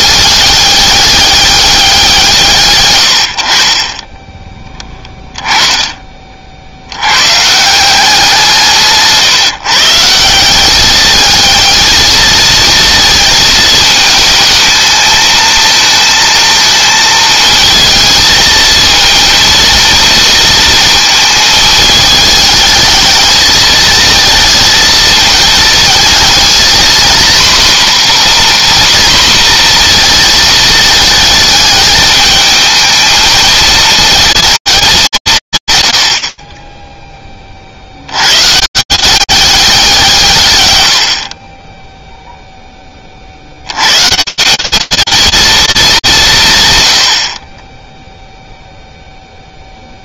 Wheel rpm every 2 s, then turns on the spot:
200, 100, 10, 80, 170, 210, 220, 220, 220, 230, 230, 220, 220, 240, 250, 220, 220, 220, 40, 140, 130, 20, 220, 120, 0.
4-6